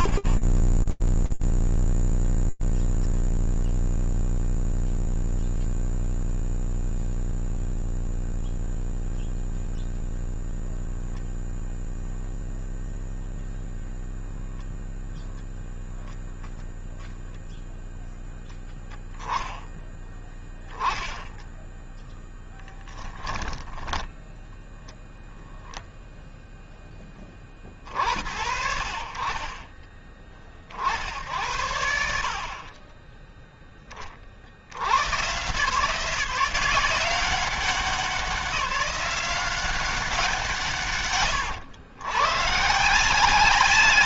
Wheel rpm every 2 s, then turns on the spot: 0, 0, 0, 0, 0, 0, 0, 0, 0, 10, 10, 0, 0, 60, 30, 50, 70, 170, 190, 160, 140, 160.
18-22